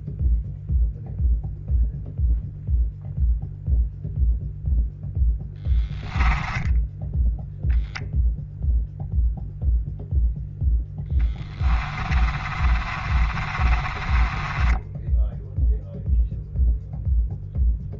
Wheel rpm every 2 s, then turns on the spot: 0, 0, 0, 10, 0, 10, 30, 10, 0.
12-16